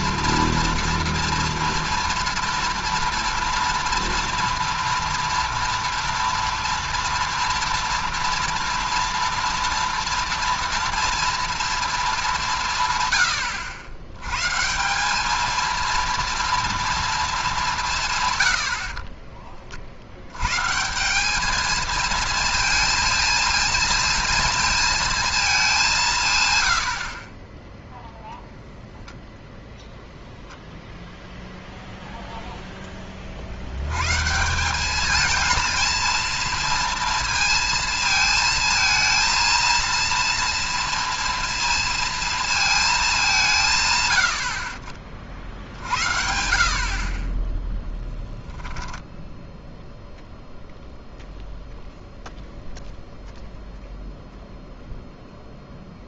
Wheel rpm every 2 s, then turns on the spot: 230, 230, 230, 230, 230, 230, 170, 140, 230, 100, 140, 230, 230, 120, 0, 0, 0, 180, 230, 230, 230, 230, 70, 60, 0, 0, 0, 0.
none